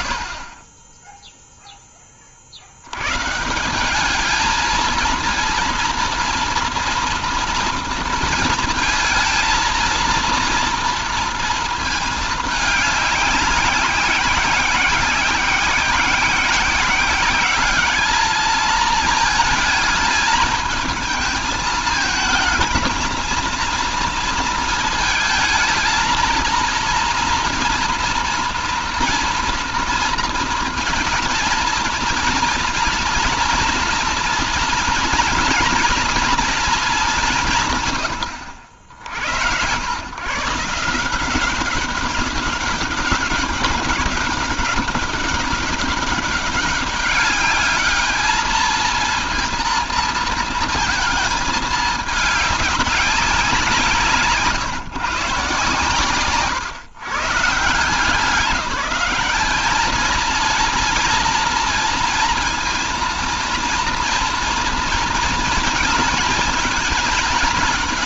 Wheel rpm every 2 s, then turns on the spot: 30, 90, 230, 230, 220, 230, 200, 180, 190, 220, 220, 230, 230, 230, 230, 230, 230, 230, 220, 70, 160, 200, 200, 200, 220, 220, 200, 130, 130, 200, 230, 230, 230, 220.
none